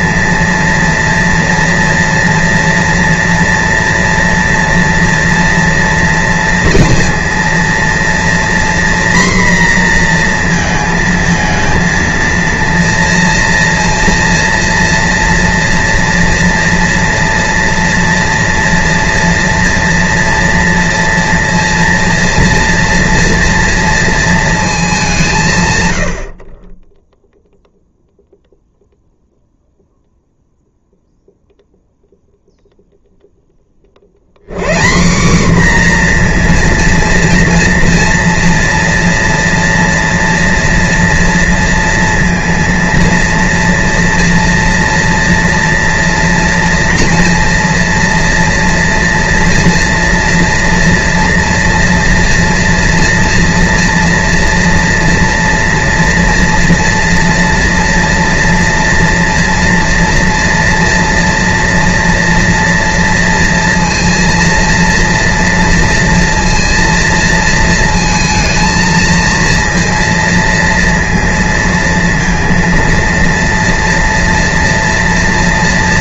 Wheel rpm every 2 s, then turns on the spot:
230, 230, 230, 230, 240, 230, 230, 230, 230, 230, 230, 230, 210, 30, 0, 0, 0, 150, 240, 230, 230, 230, 240, 230, 240, 240, 240, 230, 230, 230, 230, 230, 230, 230, 230, 230, 230, 240.
none